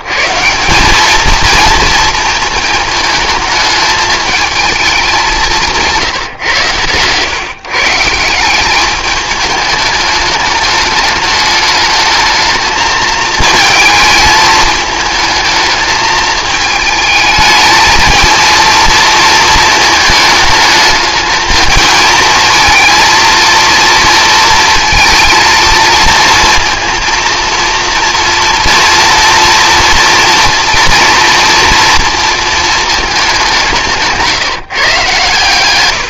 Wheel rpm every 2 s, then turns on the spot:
170, 230, 220, 120, 190, 210, 220, 220, 220, 230, 210, 220, 230, 230, 240, 230, 230, 170.
none